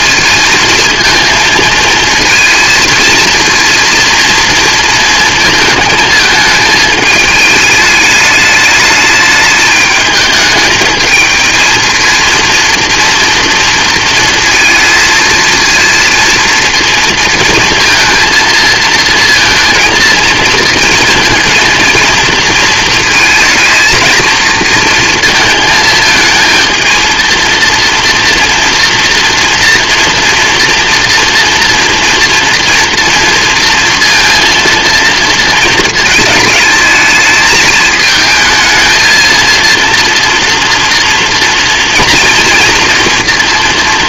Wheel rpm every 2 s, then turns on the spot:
230, 230, 230, 220, 210, 220, 230, 230, 230, 230, 230, 230, 230, 230, 230, 230, 230, 230, 220, 220, 230, 230.
none